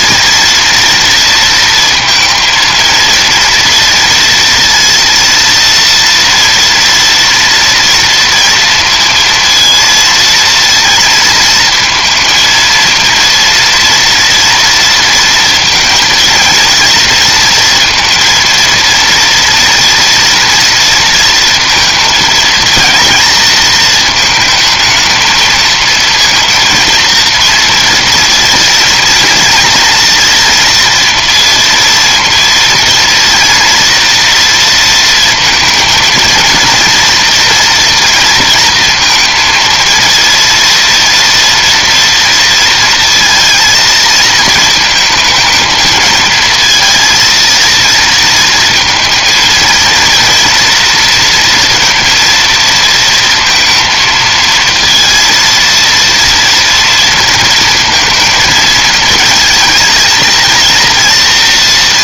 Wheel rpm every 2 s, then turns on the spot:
230, 230, 230, 230, 230, 230, 230, 230, 230, 230, 230, 230, 220, 230, 230, 230, 230, 230, 230, 230, 230, 230, 220, 220, 220, 230, 230, 230, 230, 230, 230.
none